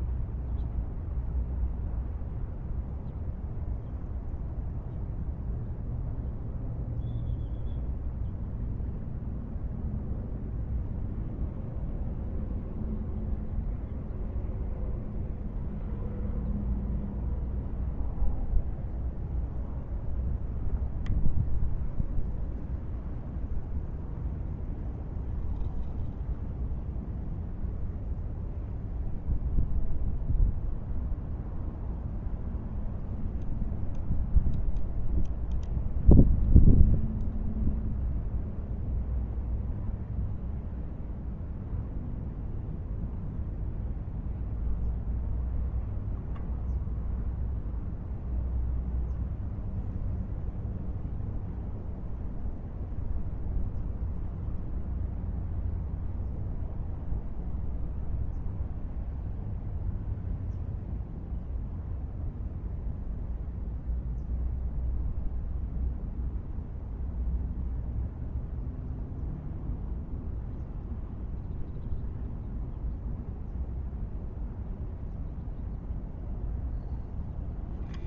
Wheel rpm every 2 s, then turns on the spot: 0, 0, 0, 0, 0, 0, 0, 0, 0, 0, 0, 0, 0, 0, 0, 0, 0, 0, 0, 0, 0, 0, 0, 0, 0, 0, 0, 0, 0, 0, 0, 0, 0, 0, 0, 0, 0, 0, 0.
none